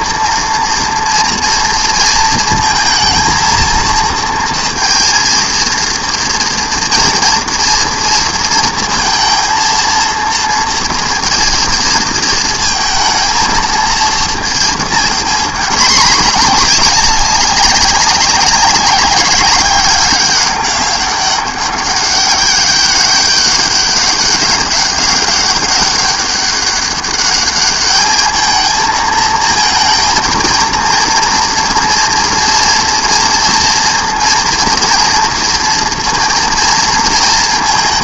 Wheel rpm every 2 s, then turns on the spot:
230, 230, 230, 230, 230, 230, 220, 220, 210, 200, 200, 200, 200, 200, 220, 230, 230, 230, 230.
none